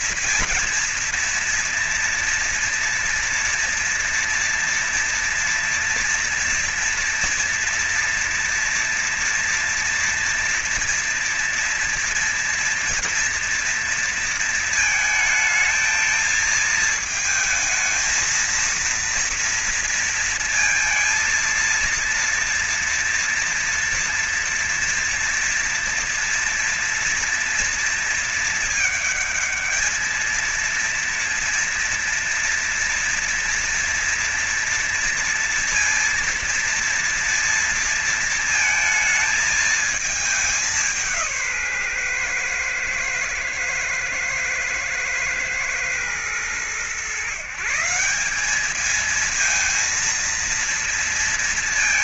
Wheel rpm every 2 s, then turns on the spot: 230, 230, 240, 230, 230, 230, 230, 230, 220, 220, 230, 230, 230, 240, 230, 230, 240, 230, 230, 230, 210, 130, 110, 110, 180, 230.
none